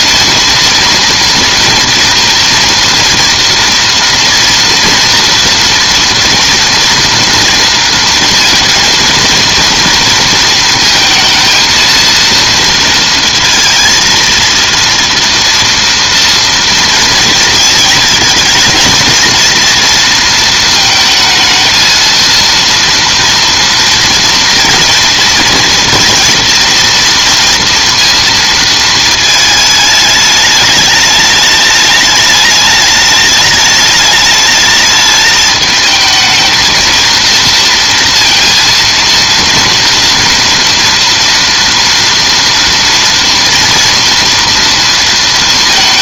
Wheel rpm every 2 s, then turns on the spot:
230, 230, 230, 230, 230, 230, 230, 230, 230, 220, 220, 230, 230, 230, 230, 210, 210, 210, 220, 230, 230, 230, 230.
none